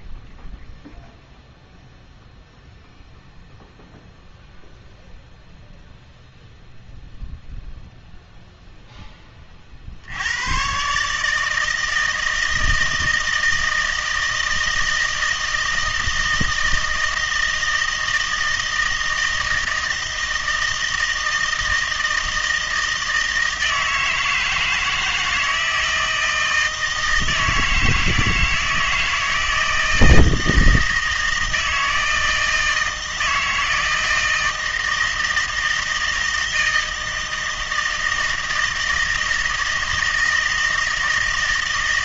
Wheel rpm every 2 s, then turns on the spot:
0, 0, 0, 0, 0, 120, 160, 160, 160, 160, 160, 160, 160, 160, 160, 160, 160, 160, 160, 160, 160.
none